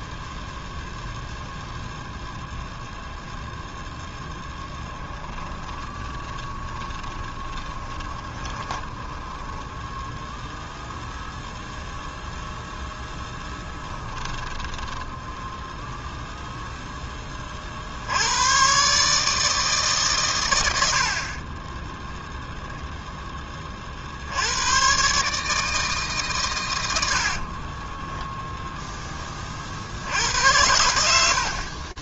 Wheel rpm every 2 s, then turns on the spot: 0, 0, 10, 20, 20, 0, 0, 10, 0, 130, 90, 0, 100, 110, 10, 100.
4-10 14-16